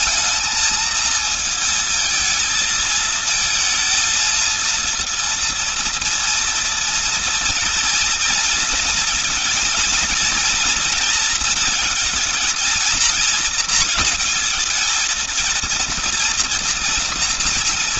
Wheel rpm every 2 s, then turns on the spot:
220, 220, 230, 230, 230, 240, 230, 220, 230.
none